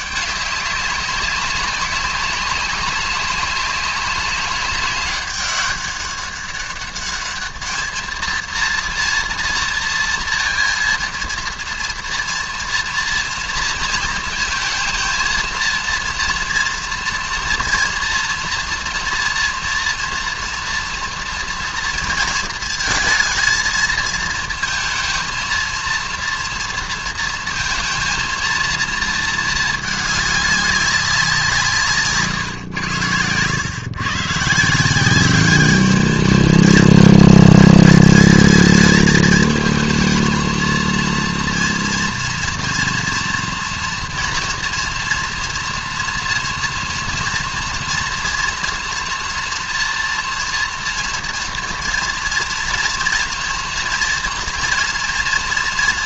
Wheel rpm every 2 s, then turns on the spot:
200, 200, 200, 200, 230, 230, 230, 230, 230, 240, 230, 230, 230, 230, 230, 200, 120, 150, 220, 220, 230, 230, 230, 230, 240, 230, 240, 230.
none